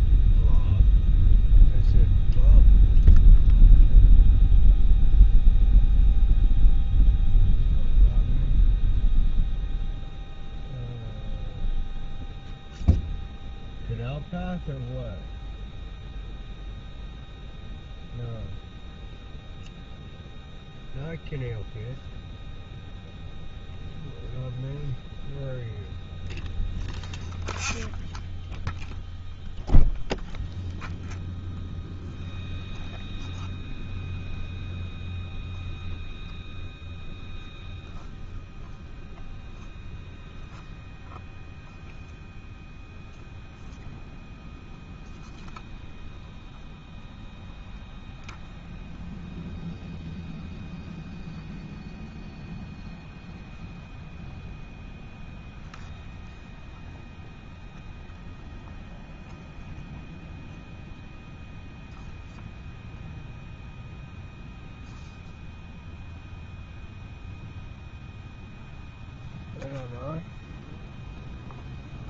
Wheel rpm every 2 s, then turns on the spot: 0, 0, 0, 0, 0, 0, 0, 0, 0, 0, 0, 0, 0, 0, 0, 0, 0, 0, 0, 0, 0, 0, 0, 0, 0, 0, 0, 0, 0, 0, 0, 0, 0, 0, 0, 0.
none